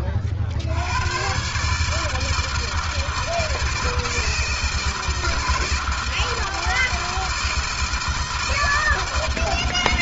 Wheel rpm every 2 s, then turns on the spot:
90, 160, 160, 160, 160.
none